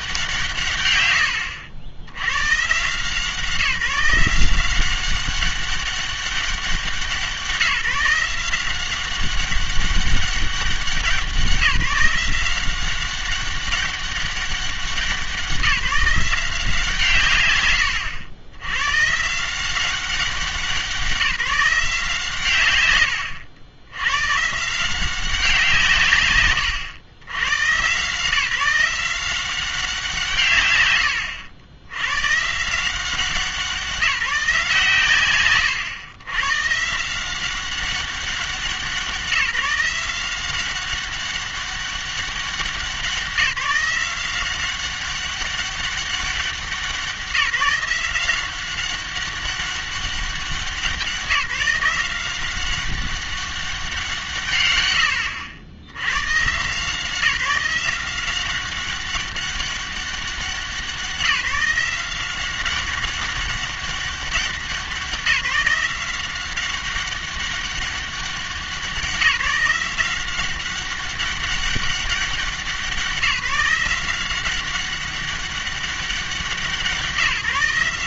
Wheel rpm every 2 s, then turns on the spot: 140, 120, 180, 190, 180, 190, 180, 190, 170, 110, 190, 110, 150, 120, 170, 120, 160, 150, 130, 190, 190, 180, 190, 180, 190, 190, 190, 110, 150, 190, 190, 190, 190, 190, 190, 190, 190, 190, 180.
none